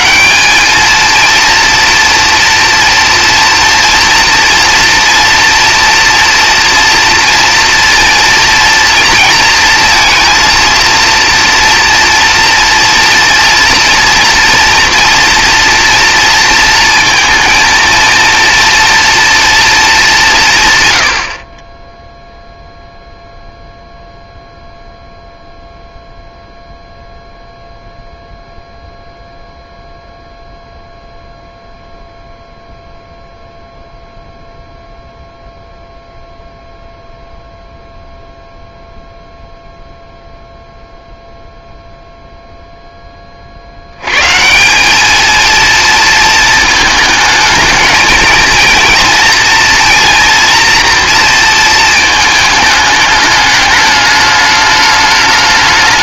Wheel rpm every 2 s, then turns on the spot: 210, 230, 230, 230, 230, 230, 230, 230, 230, 230, 140, 0, 0, 0, 0, 0, 0, 0, 0, 0, 0, 0, 190, 230, 230, 230, 210, 210.
none